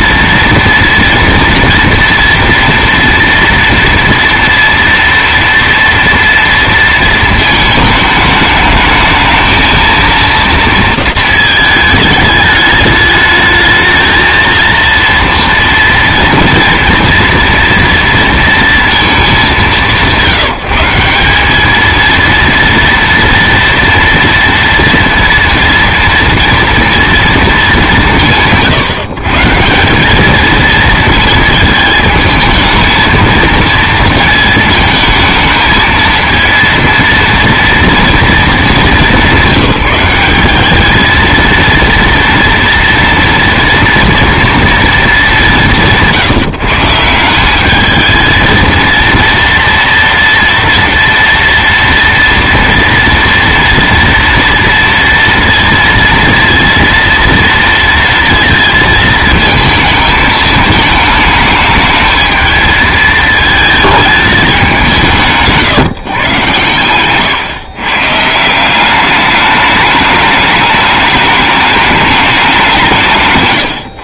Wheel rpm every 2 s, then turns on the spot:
230, 230, 230, 230, 210, 230, 210, 230, 240, 230, 180, 230, 230, 230, 150, 220, 220, 220, 230, 210, 210, 230, 220, 160, 230, 230, 230, 230, 230, 220, 220, 220, 190, 130, 190, 210, 170.
none